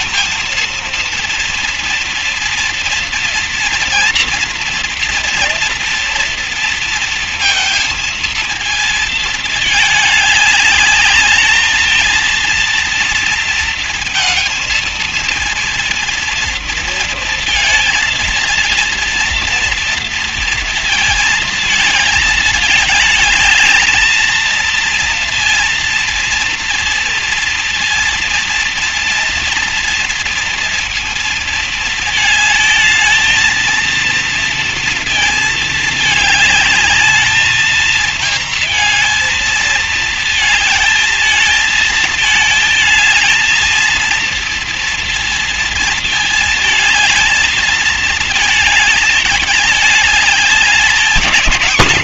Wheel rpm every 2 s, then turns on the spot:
220, 230, 230, 230, 230, 210, 220, 230, 230, 230, 230, 220, 220, 230, 230, 230, 220, 230, 210, 230, 220, 220, 230, 230, 220, 210.
none